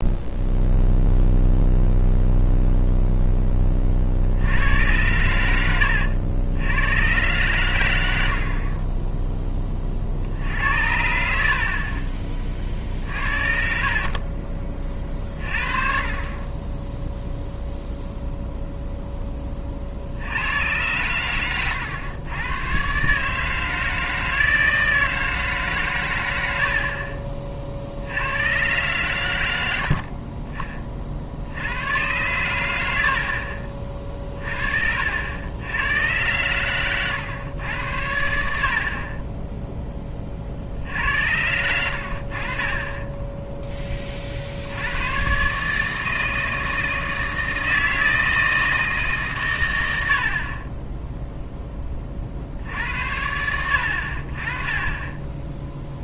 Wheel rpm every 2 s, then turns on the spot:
0, 0, 90, 100, 30, 80, 50, 30, 10, 0, 100, 130, 160, 60, 110, 30, 90, 50, 110, 50, 60, 30, 80, 160, 160, 30, 70, 20.
none